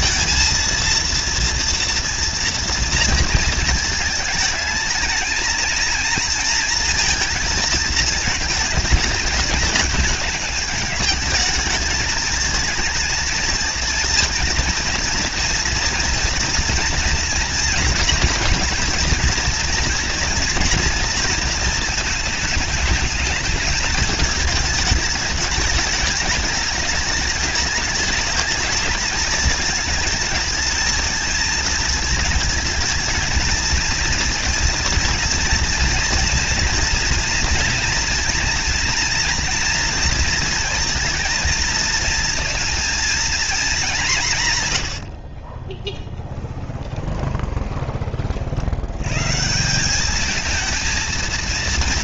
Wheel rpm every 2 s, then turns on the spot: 230, 230, 220, 230, 220, 210, 220, 230, 230, 240, 230, 220, 220, 210, 220, 220, 230, 230, 230, 230, 230, 230, 150, 10, 50, 210.
46-48